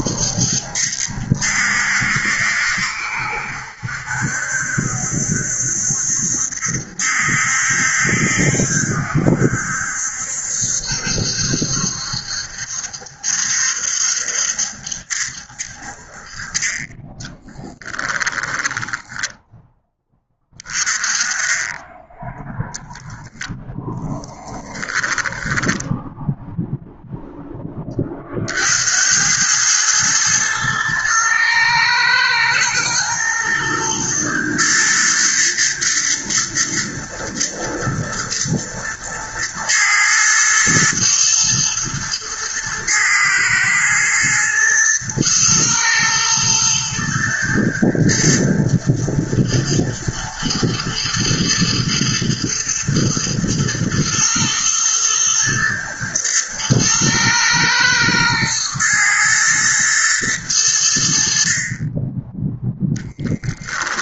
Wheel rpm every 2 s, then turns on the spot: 70, 70, 70, 70, 70, 70, 70, 70, 20, 10, 20, 0, 20, 0, 80, 110, 110, 120, 120, 120, 120, 110, 120, 110, 110, 110, 110, 110, 110, 110, 80, 10.
24-26